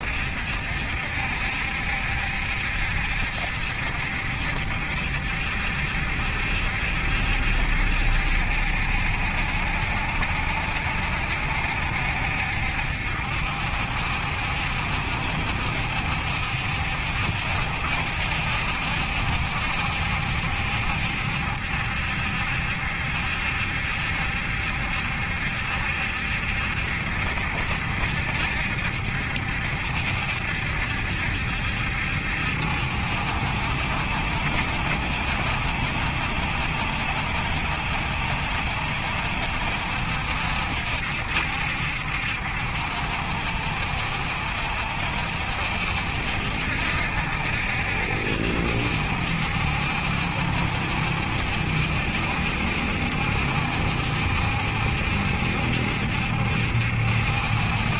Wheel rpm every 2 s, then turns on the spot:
70, 70, 70, 70, 70, 60, 60, 70, 70, 70, 70, 70, 70, 70, 70, 70, 70, 60, 70, 70, 70, 70, 70, 70, 70, 70, 70, 70, 70.
none